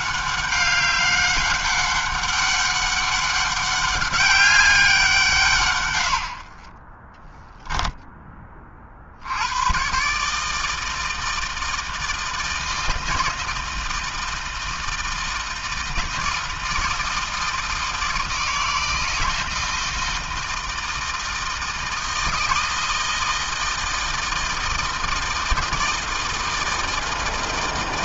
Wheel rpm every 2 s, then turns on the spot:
200, 200, 190, 20, 50, 160, 160, 160, 160, 160, 160, 160, 160, 160.
6-8